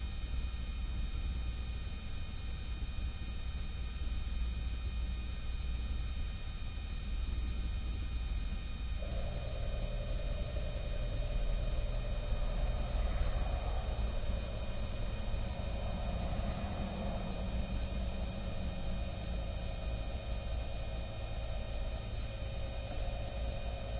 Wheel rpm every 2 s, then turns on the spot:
0, 0, 0, 0, 0, 0, 0, 0, 0, 0, 0, 0.
none